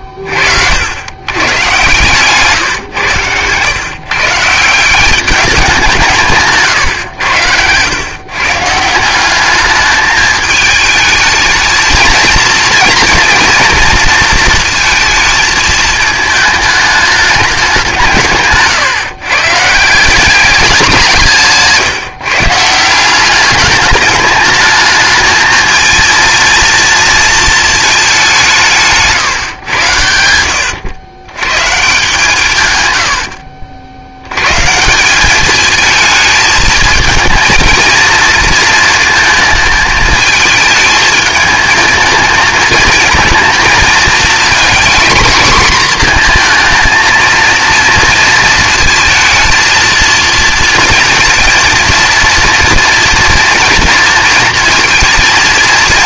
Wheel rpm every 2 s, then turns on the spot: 60, 140, 170, 140, 160, 220, 230, 220, 220, 150, 190, 160, 210, 230, 180, 100, 120, 140, 220, 230, 210, 220, 220, 230, 230, 230, 230, 230.
30-32